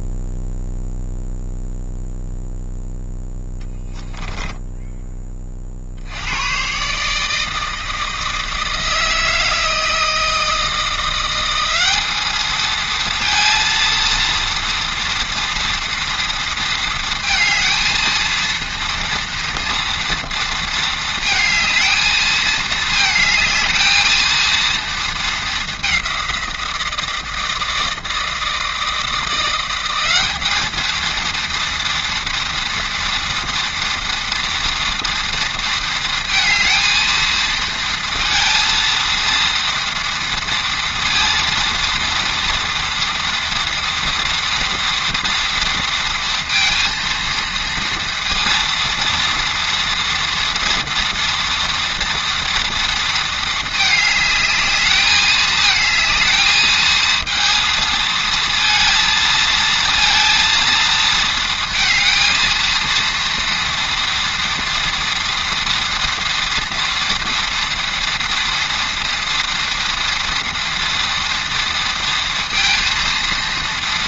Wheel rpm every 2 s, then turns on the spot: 0, 0, 10, 120, 160, 160, 220, 230, 230, 230, 230, 220, 230, 170, 160, 210, 230, 230, 230, 230, 230, 240, 230, 230, 230, 240, 230, 210, 220, 230, 230, 230, 230, 230, 230, 230, 230.
4-6